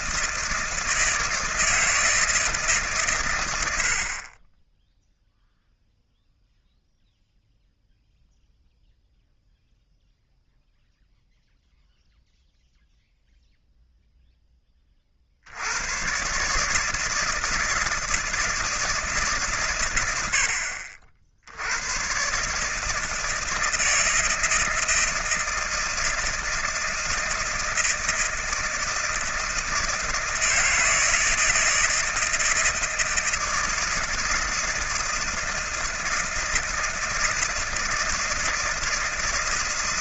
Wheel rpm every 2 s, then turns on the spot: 170, 150, 20, 0, 0, 0, 0, 10, 140, 160, 70, 150, 160, 160, 160, 160, 160, 170, 160, 160.
none